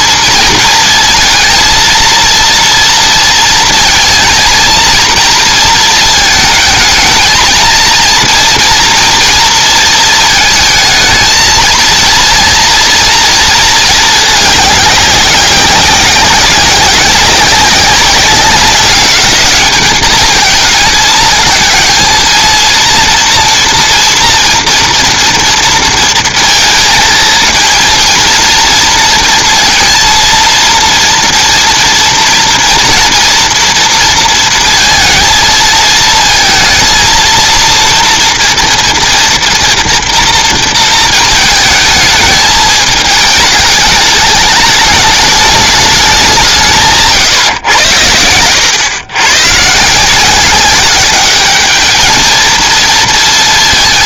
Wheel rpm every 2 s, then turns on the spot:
230, 230, 230, 220, 230, 220, 230, 200, 190, 200, 220, 230, 240, 230, 230, 230, 230, 230, 220, 230, 230, 210, 210, 150, 100, 190, 220.
none